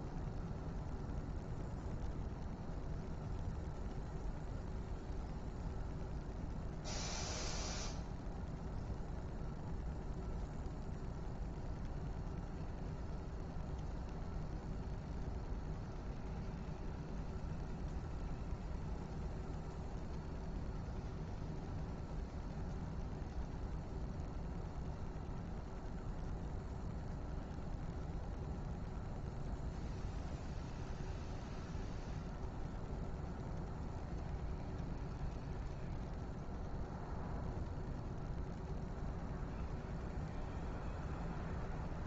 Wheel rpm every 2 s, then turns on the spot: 0, 0, 0, 0, 0, 0, 0, 0, 0, 0, 0, 0, 0, 0, 0, 0, 0, 0, 0, 0, 0.
none